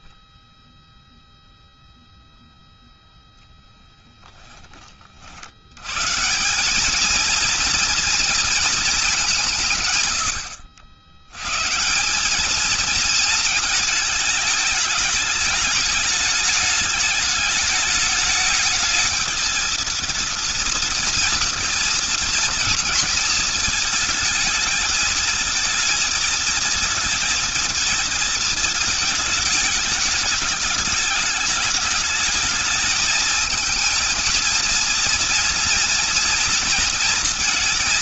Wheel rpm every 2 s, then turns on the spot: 10, 0, 20, 190, 230, 80, 220, 220, 210, 210, 230, 230, 220, 230, 220, 210, 220, 230, 230.
none